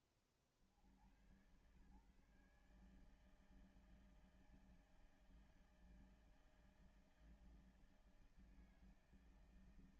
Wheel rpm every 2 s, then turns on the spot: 60, 150, 160, 160, 160.
none